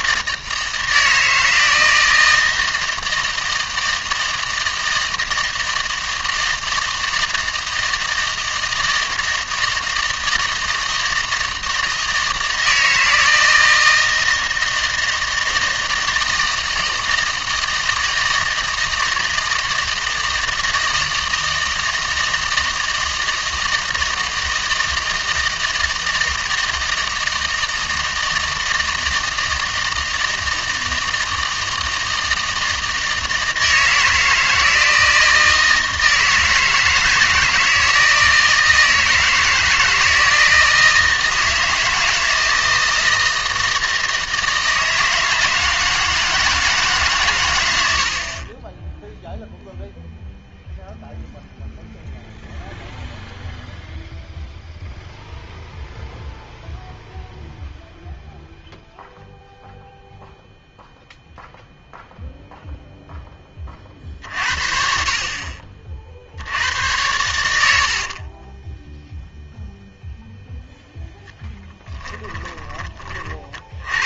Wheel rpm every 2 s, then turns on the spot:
160, 160, 160, 160, 160, 160, 160, 160, 160, 160, 160, 160, 160, 160, 160, 160, 160, 160, 160, 160, 160, 160, 160, 160, 30, 0, 0, 0, 0, 0, 0, 0, 60, 80, 10, 0, 20.
68-70 72-74